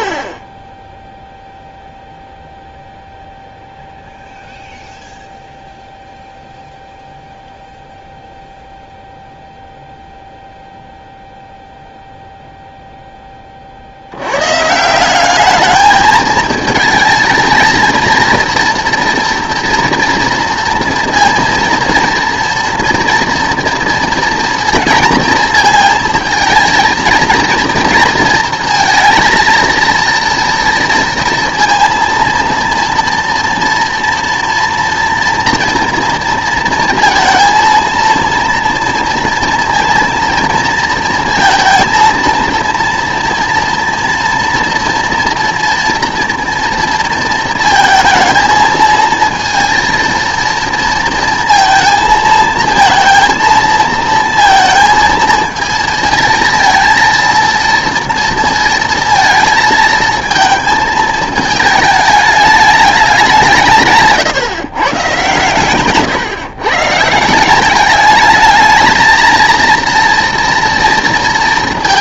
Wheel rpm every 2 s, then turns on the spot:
10, 0, 0, 0, 0, 0, 0, 140, 220, 230, 230, 230, 230, 220, 230, 230, 230, 230, 230, 230, 230, 230, 230, 230, 220, 230, 230, 230, 220, 230, 230, 210, 140, 130, 220, 230.
none